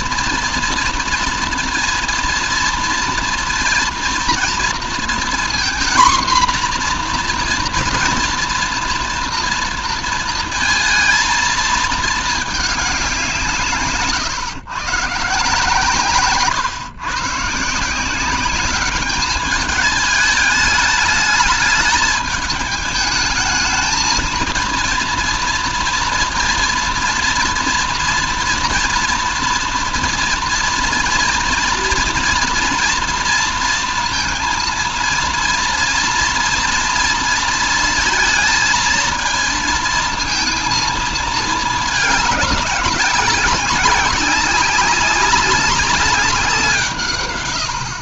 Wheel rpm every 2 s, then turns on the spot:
230, 230, 230, 240, 230, 230, 210, 140, 140, 190, 210, 210, 230, 230, 230, 230, 230, 230, 230, 230, 220, 200, 190, 180.
none